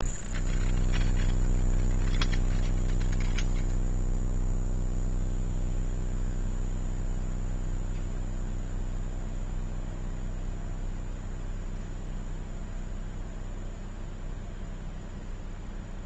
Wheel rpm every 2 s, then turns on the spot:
0, 0, 0, 0, 0, 0, 0, 0.
none